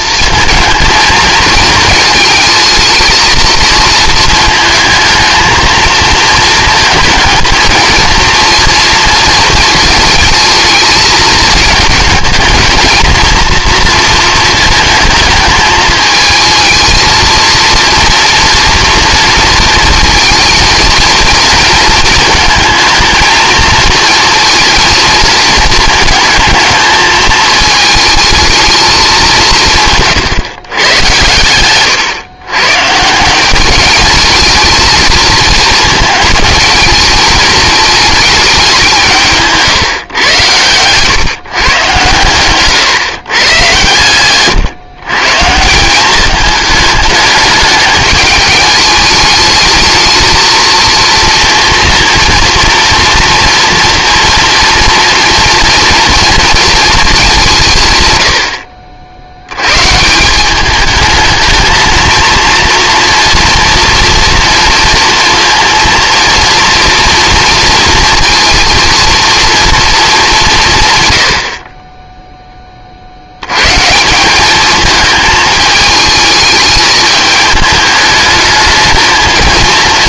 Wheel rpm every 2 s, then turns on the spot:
230, 220, 220, 220, 230, 220, 230, 230, 220, 230, 220, 220, 230, 220, 210, 120, 140, 220, 220, 190, 120, 130, 130, 220, 210, 230, 230, 230, 220, 60, 210, 230, 230, 230, 230, 140, 40, 220, 220, 220.
none